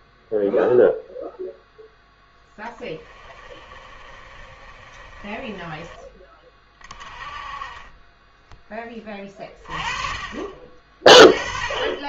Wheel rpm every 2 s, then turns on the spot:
0, 10, 30, 30, 10, 40.
2-6